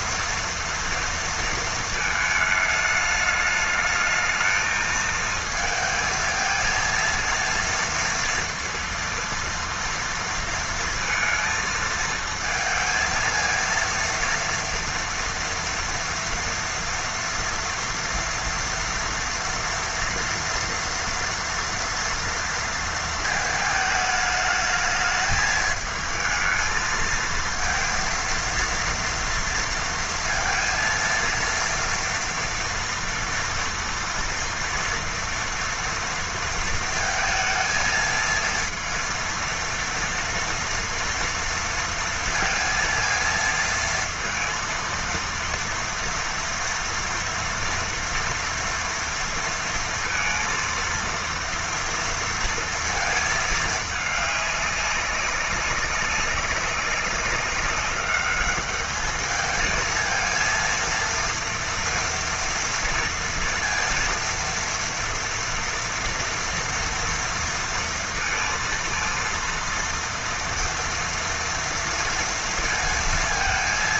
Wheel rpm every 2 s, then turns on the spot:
230, 220, 220, 230, 230, 230, 230, 230, 230, 230, 240, 230, 210, 220, 230, 230, 230, 230, 230, 230, 230, 230, 230, 230, 230, 230, 230, 200, 200, 200, 230, 230, 230, 230, 230, 230, 230.
none